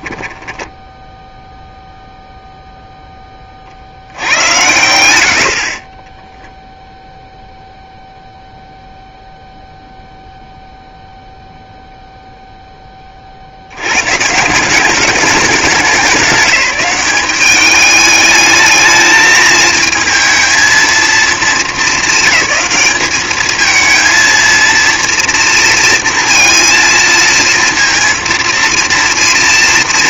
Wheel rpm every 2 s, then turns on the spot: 10, 0, 90, 0, 0, 0, 0, 180, 200, 210, 220, 220, 230, 230, 230.
0-2